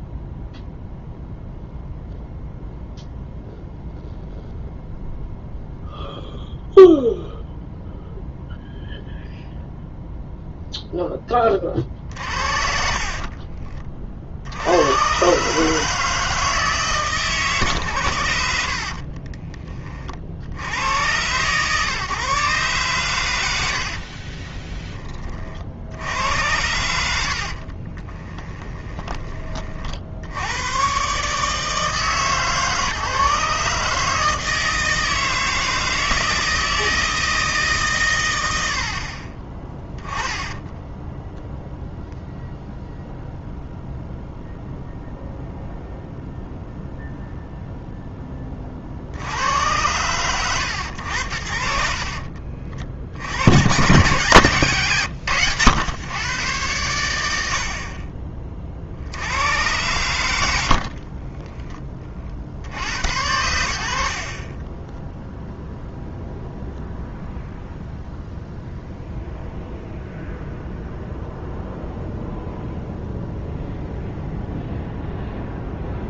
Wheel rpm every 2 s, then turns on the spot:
0, 0, 0, 0, 0, 0, 50, 100, 150, 70, 90, 130, 30, 90, 20, 110, 140, 160, 160, 80, 0, 0, 0, 0, 30, 100, 60, 120, 100, 50, 60, 60, 20, 0, 0, 0, 0, 0.
12-14 18-20 24-26 28-30 60-62